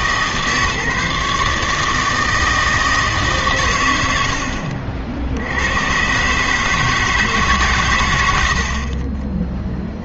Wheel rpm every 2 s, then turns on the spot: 140, 160, 60, 150, 60.
none